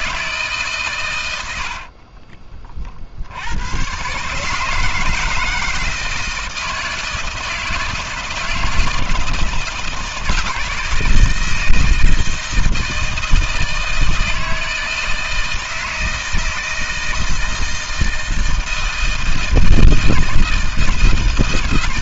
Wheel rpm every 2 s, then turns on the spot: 130, 40, 160, 160, 170, 160, 160, 160, 160, 160, 160.
none